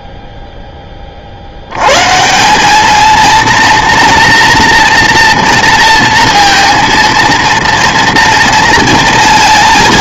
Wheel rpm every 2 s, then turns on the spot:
10, 190, 240, 230, 230.
none